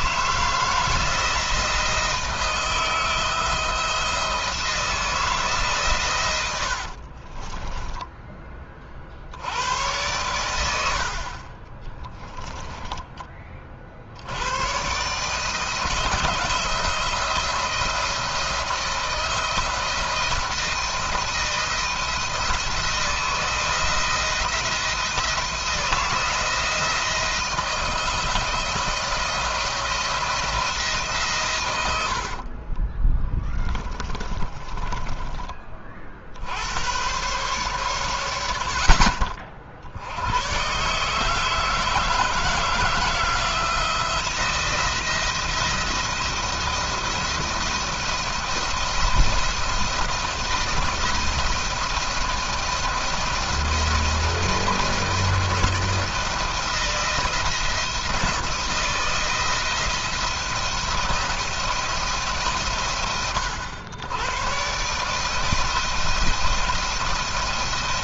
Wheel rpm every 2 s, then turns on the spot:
160, 160, 170, 70, 30, 80, 10, 110, 170, 170, 160, 160, 170, 160, 170, 160, 30, 20, 80, 70, 120, 160, 170, 170, 170, 170, 170, 170, 170, 170, 170, 120, 130, 170.
6-8 10-14 32-36